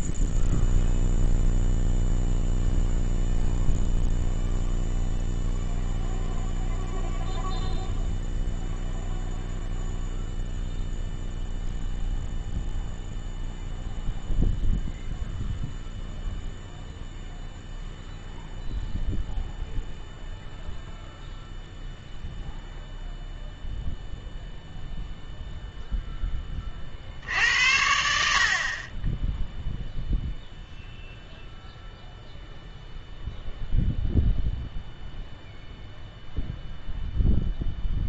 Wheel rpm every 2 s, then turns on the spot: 0, 0, 0, 0, 0, 0, 0, 0, 0, 0, 0, 0, 0, 40, 40, 0, 0, 0, 0.
none